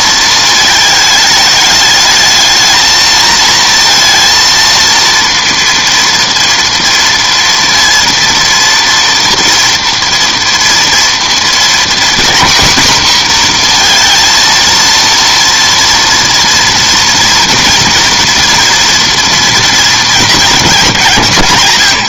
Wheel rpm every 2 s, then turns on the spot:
220, 220, 230, 230, 230, 240, 250, 230, 230, 240, 200.
none